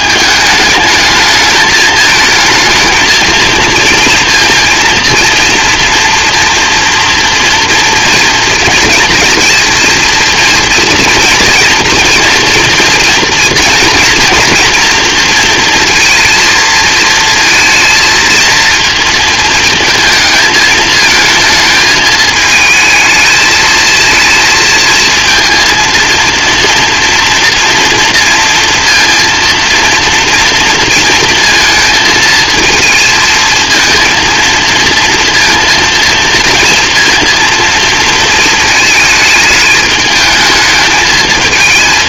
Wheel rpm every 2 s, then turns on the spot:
210, 220, 230, 240, 230, 230, 230, 240, 230, 230, 220, 220, 230, 230, 230, 230, 220, 230, 230, 220, 220.
none